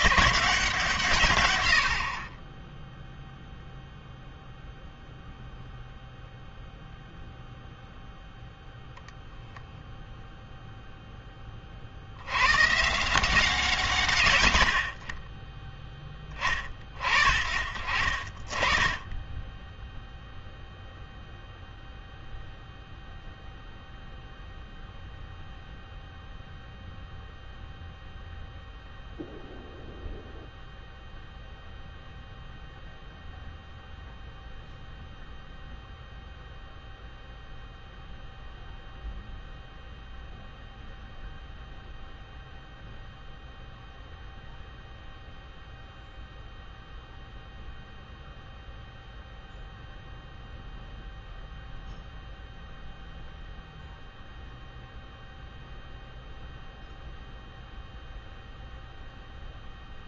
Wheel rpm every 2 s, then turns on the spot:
110, 0, 0, 0, 0, 30, 160, 20, 40, 10, 0, 0, 0, 0, 0, 0, 0, 0, 0, 0, 0, 0, 0, 0, 0, 0, 0, 0, 0, 0.
none